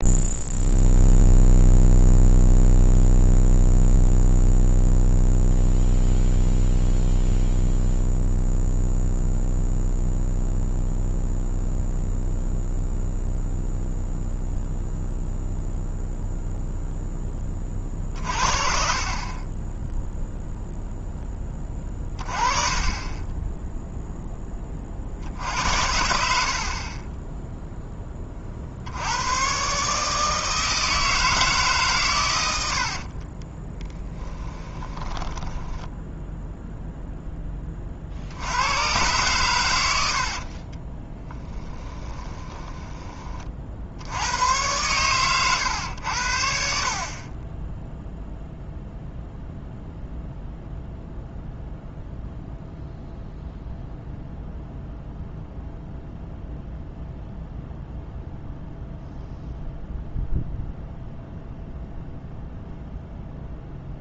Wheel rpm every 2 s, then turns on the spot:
0, 0, 0, 0, 0, 0, 0, 0, 0, 50, 0, 20, 20, 50, 50, 160, 80, 10, 0, 90, 40, 20, 100, 60, 0, 0, 0, 0, 0, 0, 0, 0.
26-28 32-36 40-44